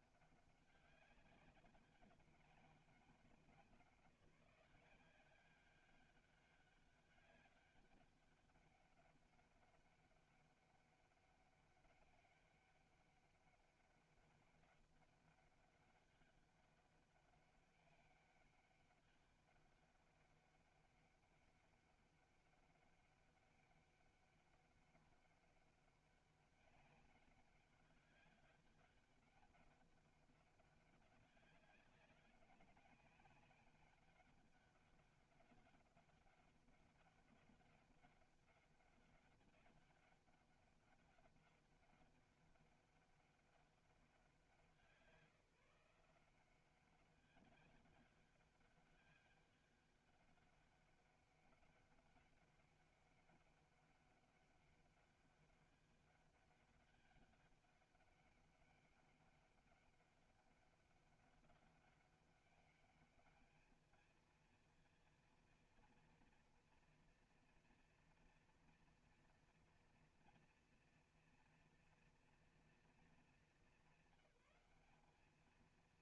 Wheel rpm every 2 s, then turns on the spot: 200, 200, 180, 200, 200, 200, 200, 200, 200, 200, 200, 200, 200, 200, 200, 200, 200, 200, 200, 200, 200, 200, 180, 180, 200, 200, 200, 200, 200, 200, 200, 200, 230, 240, 230, 230, 230, 200.
none